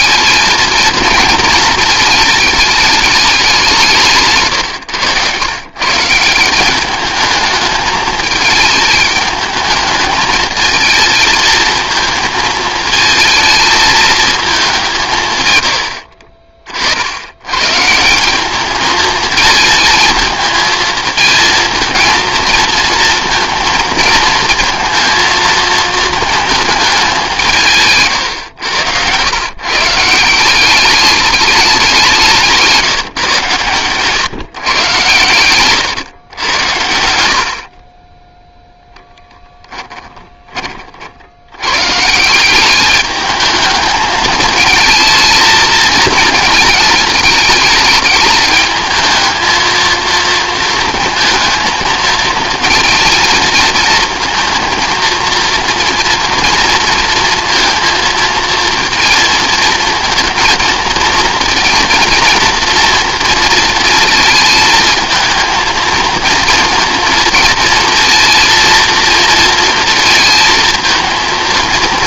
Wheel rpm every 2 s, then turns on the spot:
220, 210, 120, 200, 210, 220, 220, 200, 40, 210, 220, 230, 230, 220, 110, 180, 170, 130, 90, 10, 30, 180, 220, 220, 220, 230, 220, 230, 230, 230, 230, 230, 220, 220, 230, 230.
28-30 40-42